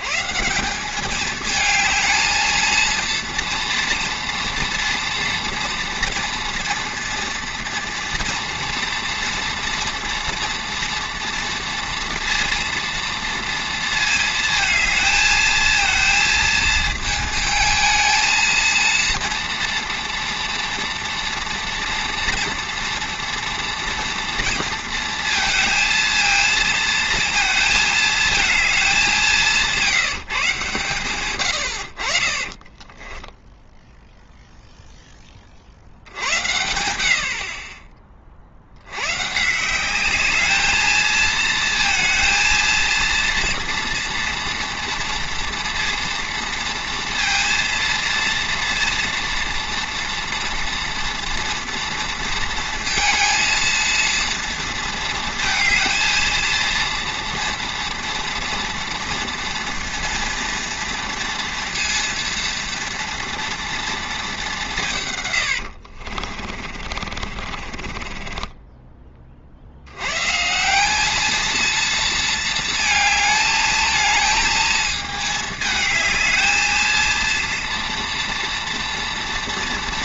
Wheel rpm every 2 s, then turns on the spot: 160, 230, 230, 230, 230, 230, 230, 220, 220, 230, 230, 240, 230, 220, 210, 150, 30, 0, 70, 70, 220, 230, 230, 230, 230, 230, 230, 230, 230, 230, 240, 230, 180, 50, 20, 170, 220, 220, 220, 230.
32-34 66-70